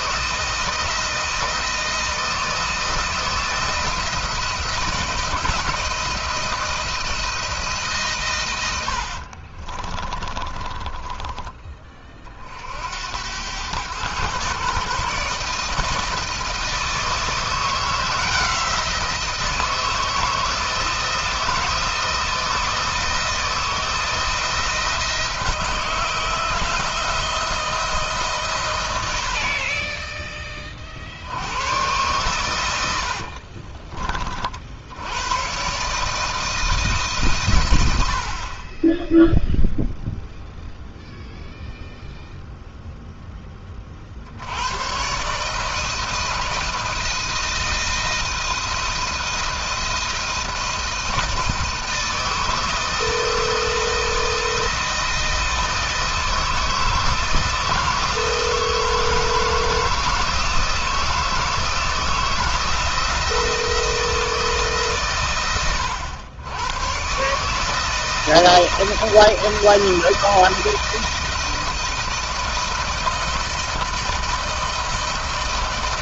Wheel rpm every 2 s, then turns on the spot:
160, 160, 160, 160, 80, 20, 60, 130, 160, 170, 160, 160, 170, 160, 110, 40, 90, 60, 150, 30, 0, 0, 100, 170, 160, 160, 160, 160, 160, 170, 170, 170, 150, 120, 170, 160, 160, 160.
8-12 32-34